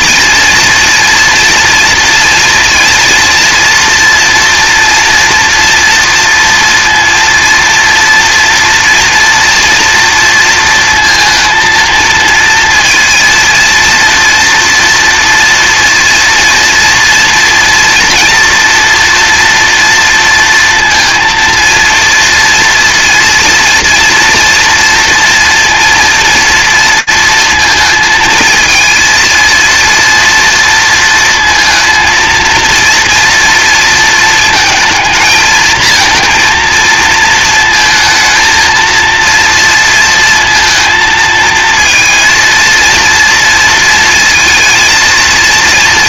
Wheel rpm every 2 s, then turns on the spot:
230, 230, 240, 230, 240, 230, 230, 230, 230, 230, 230, 230, 230, 230, 230, 230, 230, 220, 230, 230, 230, 230, 230.
none